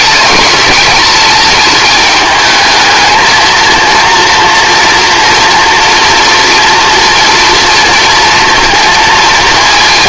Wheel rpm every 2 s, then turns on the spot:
210, 210, 230, 230, 230.
none